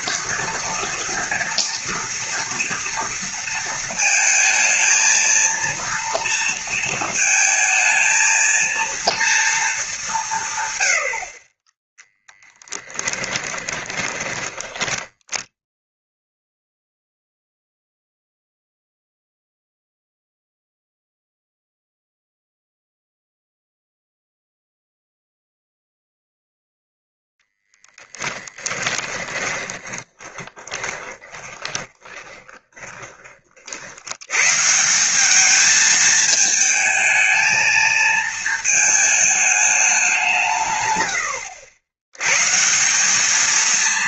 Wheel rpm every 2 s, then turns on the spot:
230, 230, 220, 230, 230, 120, 10, 10, 0, 0, 0, 0, 0, 0, 10, 20, 10, 160, 220, 220, 110, 170.
12-16 28-32